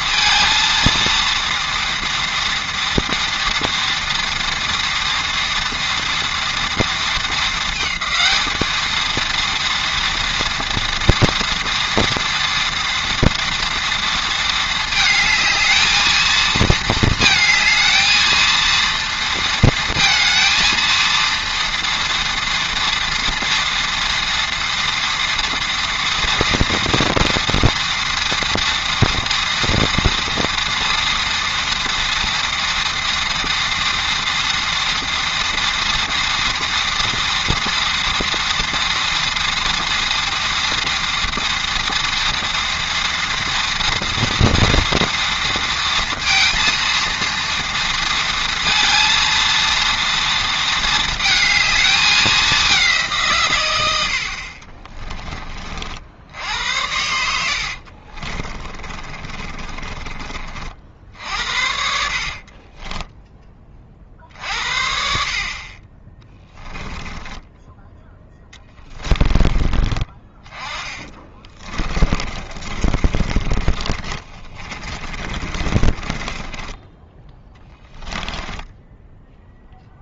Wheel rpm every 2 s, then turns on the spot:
230, 230, 230, 230, 220, 230, 230, 220, 220, 230, 230, 230, 230, 230, 230, 230, 230, 230, 240, 230, 230, 230, 230, 230, 230, 230, 200, 50, 80, 30, 40, 50, 50, 10, 10, 20, 30, 30, 20, 10.
58-60 62-64 66-70 72-80